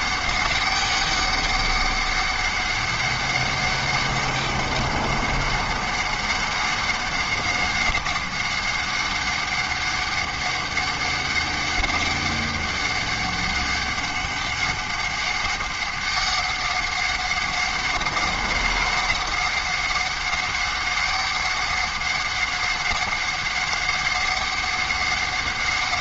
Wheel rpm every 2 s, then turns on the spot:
200, 200, 200, 200, 200, 200, 200, 200, 200, 200, 200, 200, 200.
none